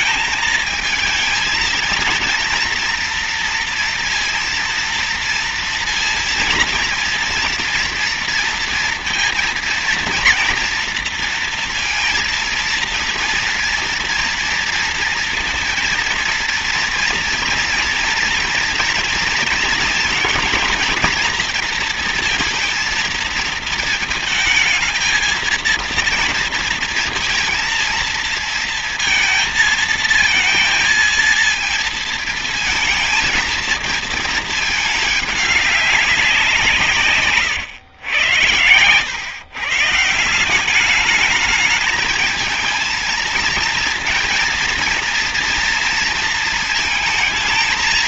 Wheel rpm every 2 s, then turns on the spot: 220, 240, 230, 230, 230, 230, 230, 230, 230, 230, 220, 230, 220, 230, 230, 230, 230, 210, 150, 120, 200, 220, 230, 220.
none